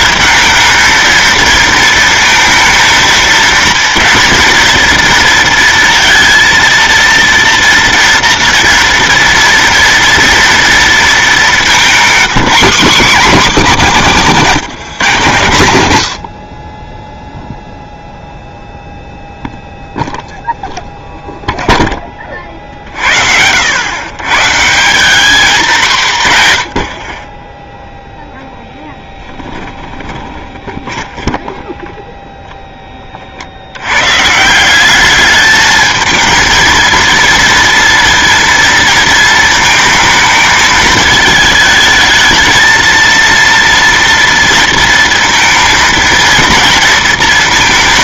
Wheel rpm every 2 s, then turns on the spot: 220, 220, 230, 230, 230, 230, 220, 170, 20, 0, 0, 50, 160, 100, 10, 20, 10, 180, 230, 230, 220, 230, 230, 230.
28-32